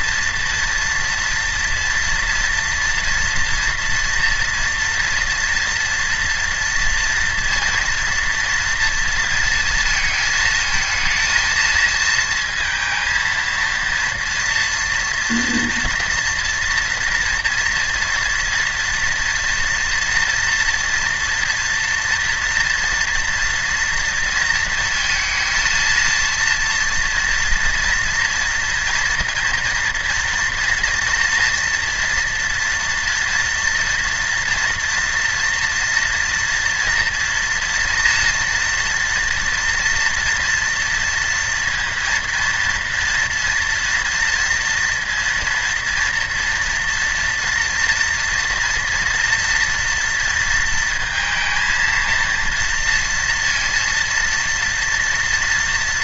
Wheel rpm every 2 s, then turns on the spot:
230, 230, 230, 230, 230, 220, 230, 230, 230, 240, 240, 230, 230, 230, 230, 230, 230, 230, 240, 230, 230, 230, 230, 230, 240, 230, 230, 230.
none